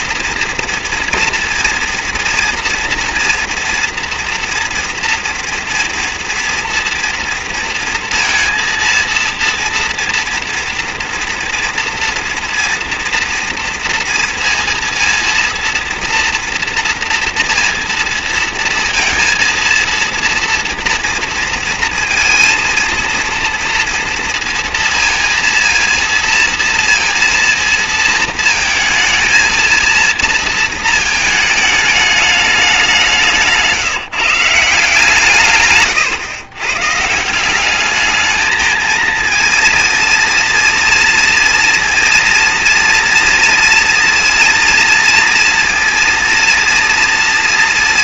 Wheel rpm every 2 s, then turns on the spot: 230, 230, 240, 230, 230, 230, 230, 230, 230, 230, 230, 230, 230, 230, 220, 230, 200, 160, 130, 220, 230, 230, 230, 230.
none